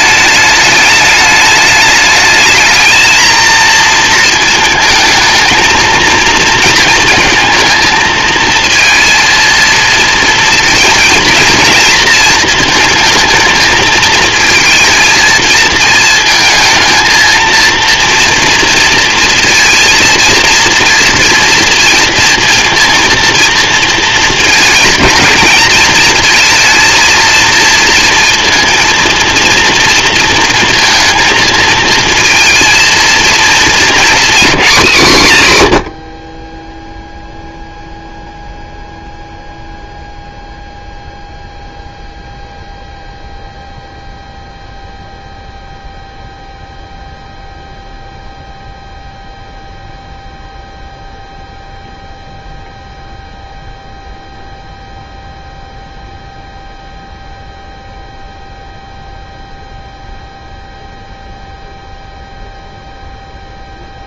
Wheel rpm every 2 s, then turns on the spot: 210, 210, 230, 230, 230, 230, 220, 220, 220, 230, 230, 230, 230, 220, 230, 230, 230, 230, 110, 0, 0, 0, 0, 0, 0, 0, 0, 0, 0, 0, 0, 0.
none